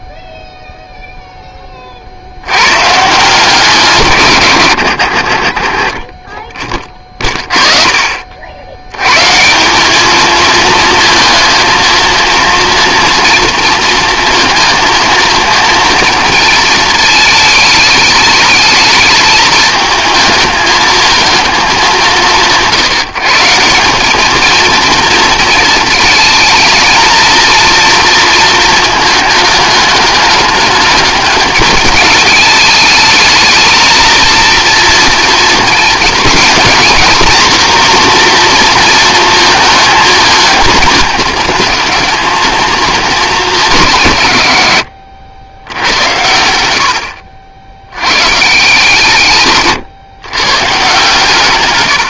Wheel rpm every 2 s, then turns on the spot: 0, 120, 90, 30, 90, 230, 230, 230, 220, 220, 220, 170, 220, 220, 220, 210, 210, 230, 220, 230, 220, 220, 100, 80, 150, 150.
46-48